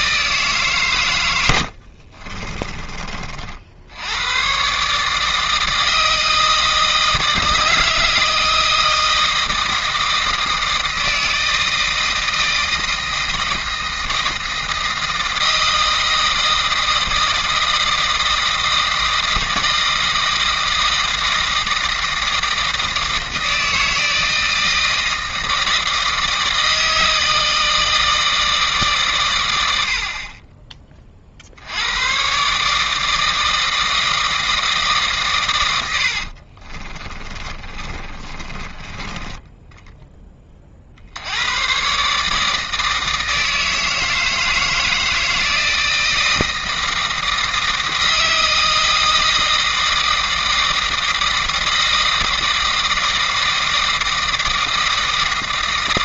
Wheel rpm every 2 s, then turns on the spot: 130, 20, 130, 160, 160, 160, 160, 160, 160, 160, 160, 160, 160, 160, 150, 20, 140, 160, 40, 20, 30, 160, 160, 160, 160, 160, 160, 160.
2-4 36-40